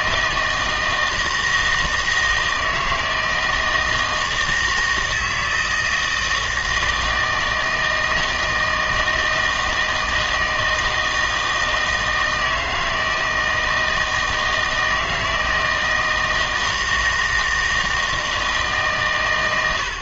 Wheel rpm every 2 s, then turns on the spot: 160, 160, 160, 160, 160, 160, 160, 160, 160, 150.
none